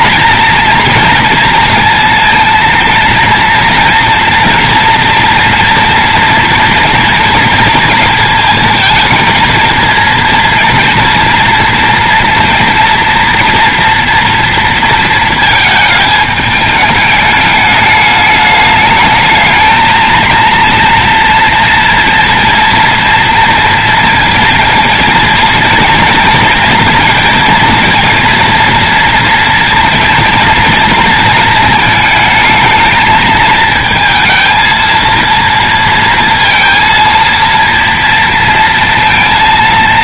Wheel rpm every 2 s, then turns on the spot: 230, 230, 230, 230, 220, 230, 240, 230, 210, 210, 230, 230, 230, 230, 230, 230, 220, 220, 230, 230.
none